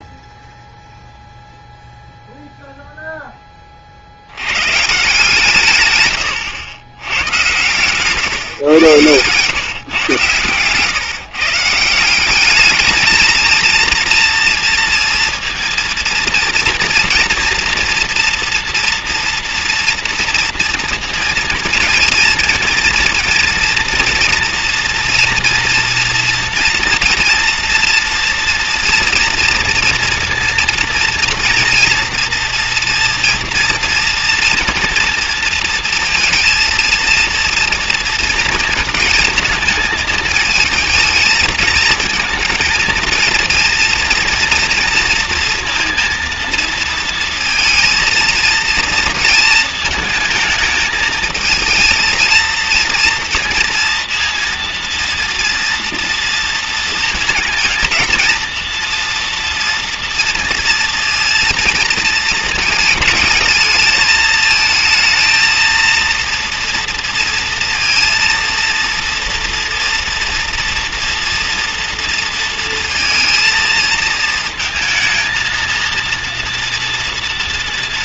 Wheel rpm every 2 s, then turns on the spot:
0, 0, 110, 100, 130, 120, 200, 230, 230, 230, 230, 230, 230, 230, 230, 230, 230, 230, 230, 220, 220, 230, 230, 230, 230, 220, 230, 230, 230, 230, 230, 220, 220, 230, 230, 230, 230, 220, 230.
none